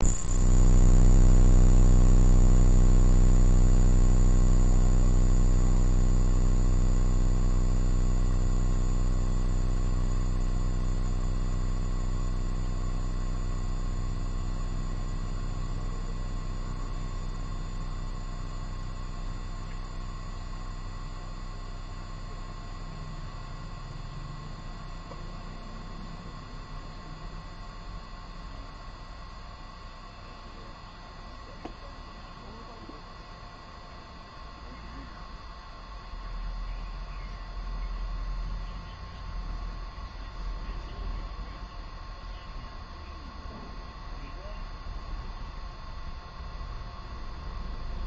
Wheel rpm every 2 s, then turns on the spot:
0, 0, 0, 0, 0, 0, 0, 0, 0, 0, 0, 0, 0, 0, 0, 0, 0, 0, 0, 0, 0, 0, 0, 0.
none